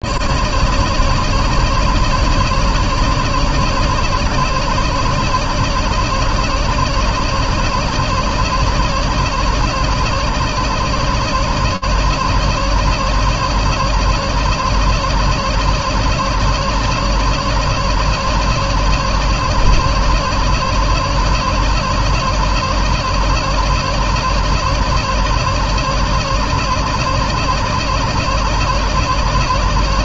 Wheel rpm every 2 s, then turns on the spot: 70, 80, 70, 70, 80, 70, 70, 70, 70, 70, 70, 70, 80, 80, 80.
none